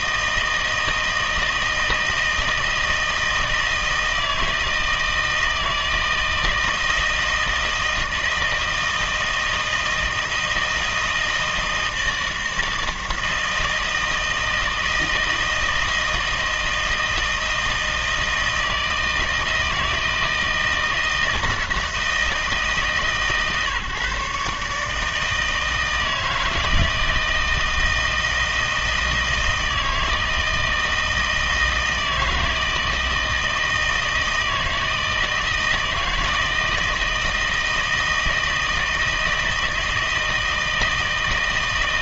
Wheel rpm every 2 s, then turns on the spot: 160, 160, 160, 160, 160, 160, 160, 160, 160, 160, 160, 150, 150, 160, 160, 160, 160, 160, 160, 160, 160.
none